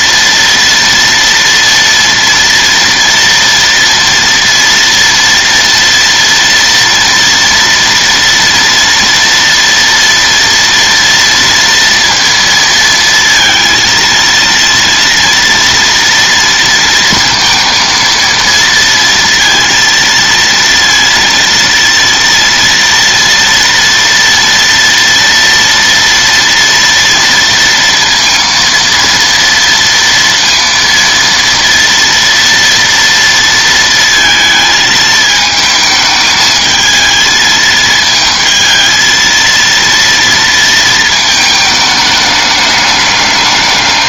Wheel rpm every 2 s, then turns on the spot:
240, 230, 240, 230, 230, 230, 230, 230, 230, 230, 230, 230, 230, 230, 230, 230, 230, 220, 220, 220, 230, 210.
none